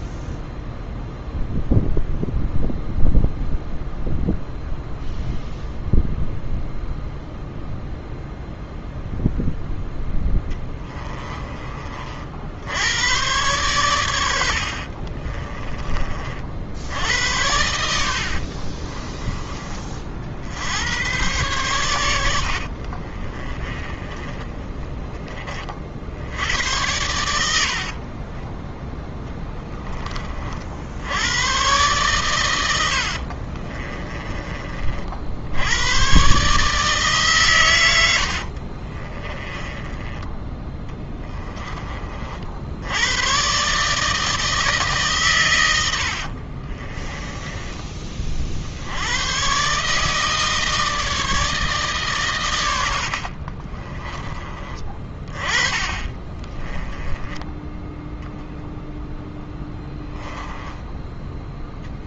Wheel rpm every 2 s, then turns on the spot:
0, 0, 0, 0, 0, 20, 90, 60, 70, 30, 100, 40, 20, 90, 10, 70, 80, 40, 150, 40, 20, 90, 150, 20, 80, 160, 80, 30, 10, 0, 10.
10-12 14-16 18-20 22-26 32-34 38-42 46-48 56-58 60-62